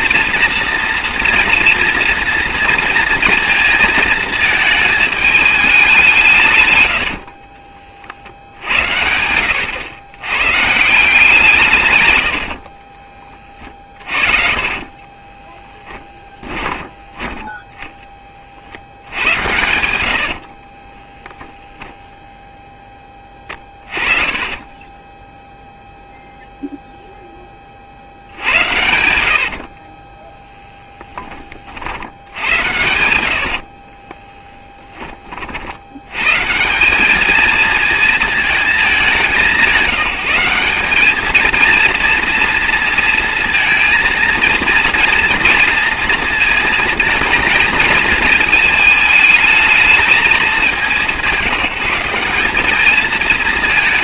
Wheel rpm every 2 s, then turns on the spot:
230, 230, 220, 110, 80, 150, 50, 30, 20, 70, 30, 10, 20, 0, 80, 10, 80, 10, 190, 210, 200, 230, 230, 230, 220, 190, 210.
12-24 28-36